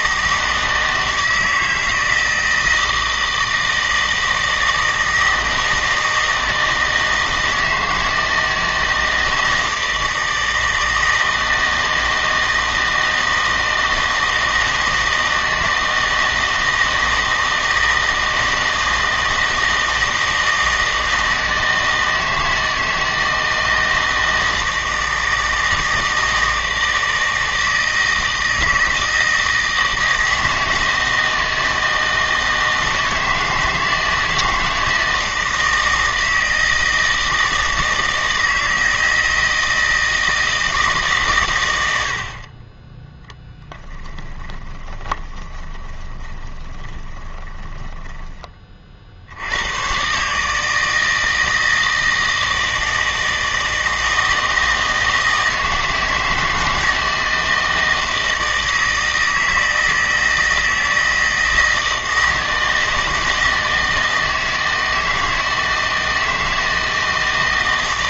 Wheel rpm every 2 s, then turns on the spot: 160, 160, 160, 160, 160, 160, 160, 160, 160, 160, 160, 160, 160, 160, 160, 160, 160, 160, 160, 160, 160, 30, 20, 20, 20, 150, 160, 160, 160, 160, 160, 160, 160, 160.
44-48